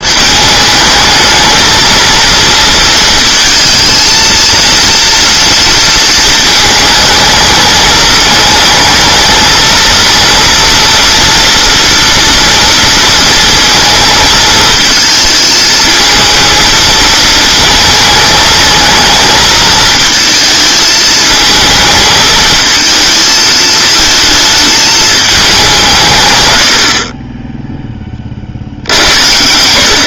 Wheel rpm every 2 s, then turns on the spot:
220, 230, 230, 220, 220, 230, 230, 220, 220, 220, 220, 220, 220, 80, 70.
none